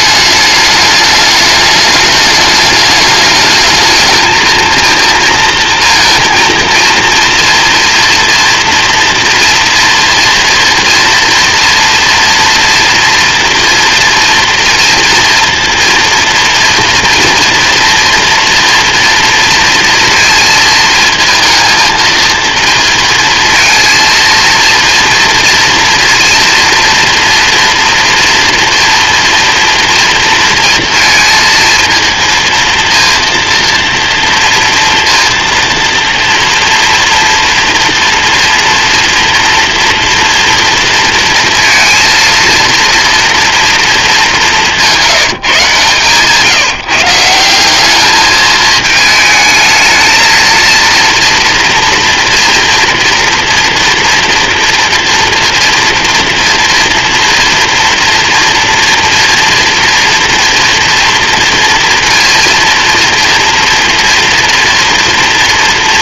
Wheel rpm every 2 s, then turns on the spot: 210, 210, 230, 230, 230, 230, 230, 230, 240, 230, 220, 230, 230, 230, 230, 230, 230, 230, 230, 230, 230, 230, 180, 160, 220, 230, 230, 230, 230, 240, 230, 230, 230.
none